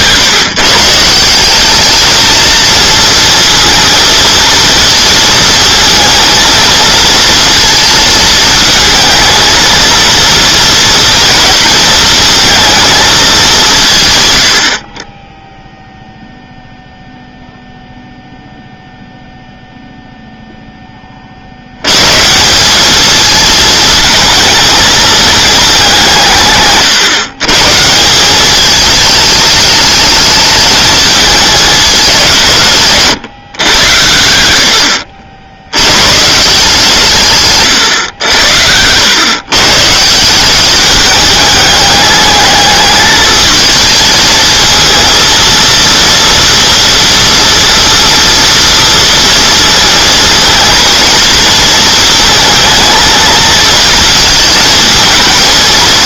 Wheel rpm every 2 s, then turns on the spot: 150, 230, 230, 230, 230, 230, 230, 120, 0, 0, 10, 200, 220, 130, 210, 220, 150, 70, 160, 100, 210, 210, 230, 230, 230, 230, 220, 220.
none